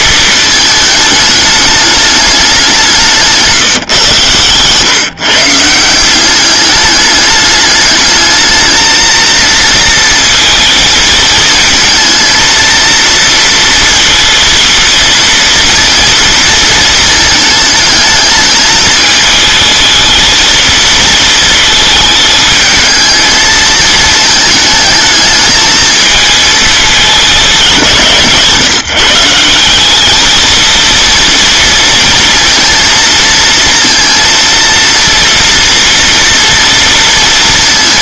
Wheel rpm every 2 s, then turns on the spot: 220, 190, 120, 200, 220, 220, 230, 230, 230, 220, 230, 220, 220, 220, 160, 230, 230, 230, 230.
none